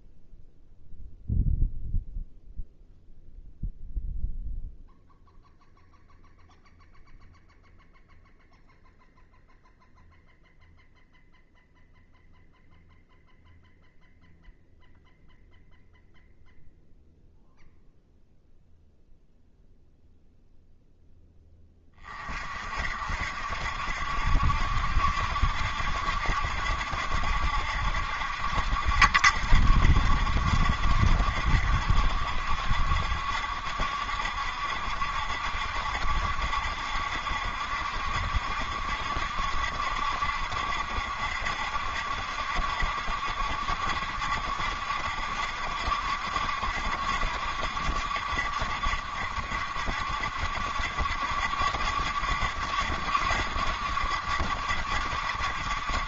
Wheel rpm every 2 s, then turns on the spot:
0, 0, 0, 0, 0, 0, 0, 0, 0, 0, 0, 50, 70, 70, 70, 70, 70, 70, 70, 70, 70, 70, 70, 70, 70, 70, 70, 70.
none